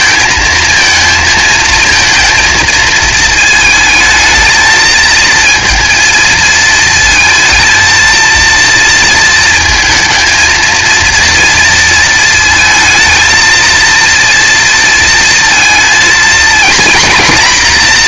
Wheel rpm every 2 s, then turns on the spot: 230, 230, 220, 230, 230, 230, 220, 230, 240.
none